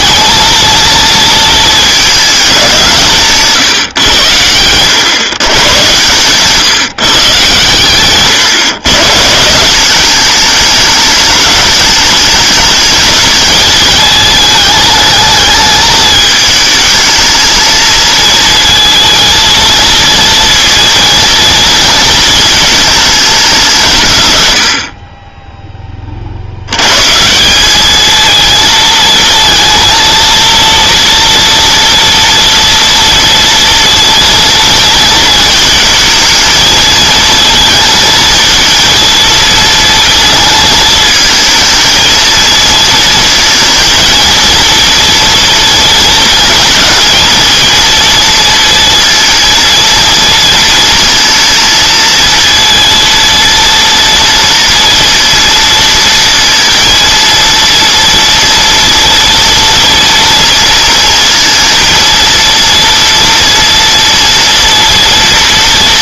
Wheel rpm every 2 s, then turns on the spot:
230, 180, 110, 150, 140, 210, 210, 220, 220, 220, 230, 220, 70, 110, 230, 230, 230, 230, 220, 230, 220, 220, 230, 220, 230, 230, 230, 240, 230, 230, 230, 230, 230.
none